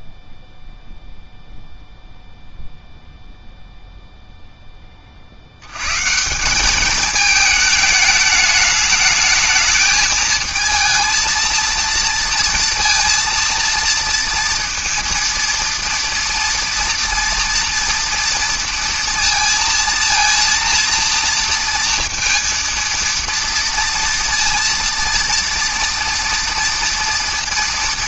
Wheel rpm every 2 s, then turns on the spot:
0, 0, 10, 190, 210, 230, 230, 230, 230, 230, 230, 230, 230, 230.
none